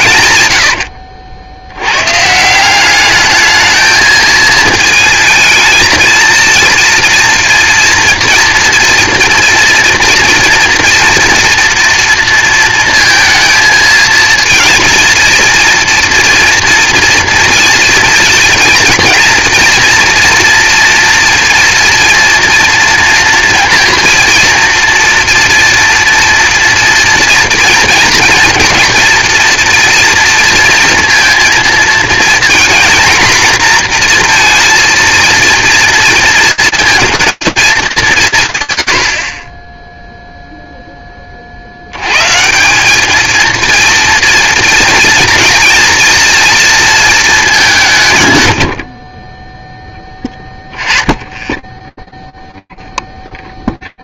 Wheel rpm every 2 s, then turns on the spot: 110, 170, 220, 230, 230, 230, 230, 230, 230, 230, 240, 230, 230, 230, 230, 230, 240, 230, 230, 110, 0, 170, 230, 230, 70, 10, 0.
0-2